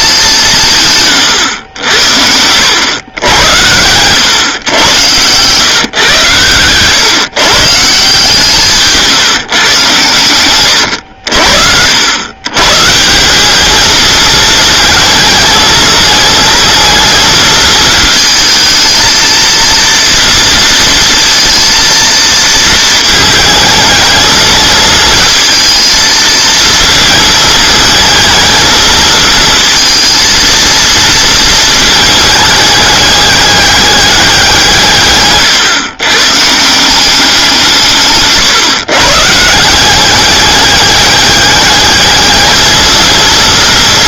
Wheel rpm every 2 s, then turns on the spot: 160, 100, 110, 120, 160, 110, 130, 220, 220, 220, 230, 230, 220, 220, 220, 230, 210, 170, 160, 140, 200, 220.
6-8